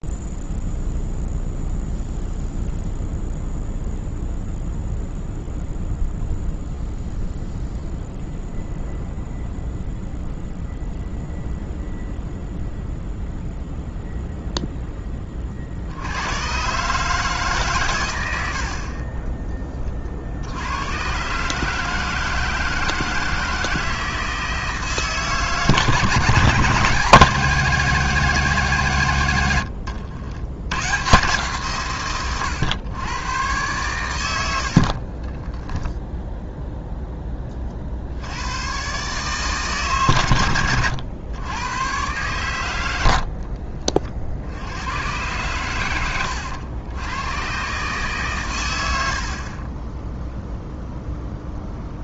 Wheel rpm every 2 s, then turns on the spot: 0, 0, 0, 0, 0, 0, 0, 0, 110, 70, 80, 160, 160, 160, 160, 110, 110, 60, 0, 110, 90, 100, 80, 100, 110, 0.
34-36